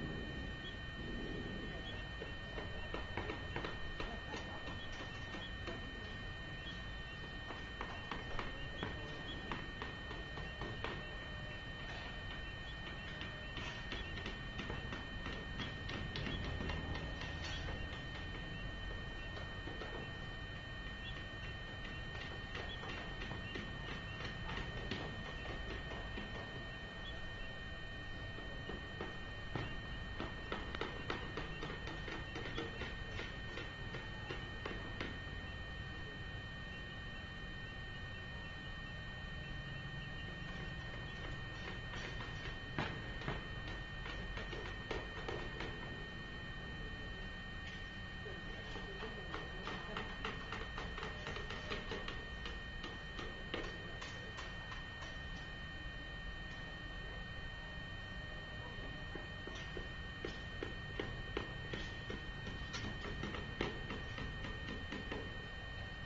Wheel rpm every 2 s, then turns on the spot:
0, 0, 0, 0, 0, 0, 0, 0, 0, 0, 0, 0, 0, 0, 0, 0, 0, 0, 0, 0, 0, 0, 0, 0, 0, 0, 0, 0, 0, 0, 0, 0, 0.
none